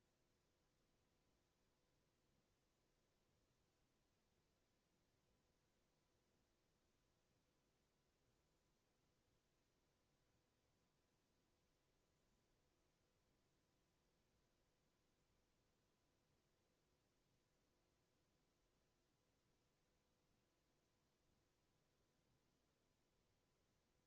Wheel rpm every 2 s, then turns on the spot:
0, 0, 0, 0, 0, 0, 0, 0, 0, 0, 0, 0.
none